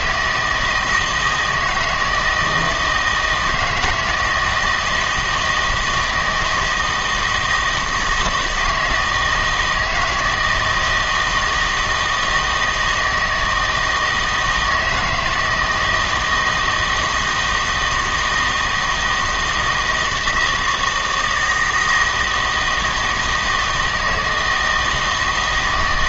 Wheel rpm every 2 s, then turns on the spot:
160, 160, 160, 160, 170, 160, 160, 160, 160, 160, 160, 160, 160.
none